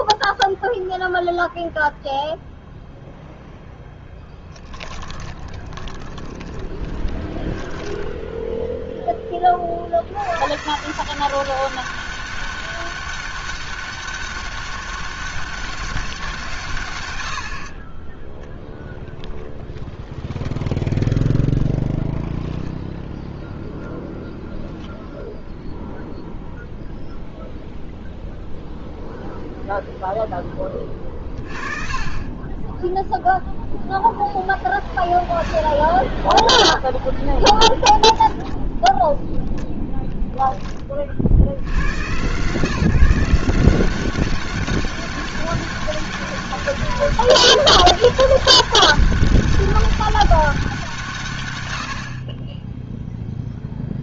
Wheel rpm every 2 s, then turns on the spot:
0, 0, 20, 30, 0, 150, 200, 200, 120, 0, 0, 0, 0, 0, 0, 20, 10, 10, 0, 10, 20, 160, 200, 200, 200, 170, 10.
4-8 52-54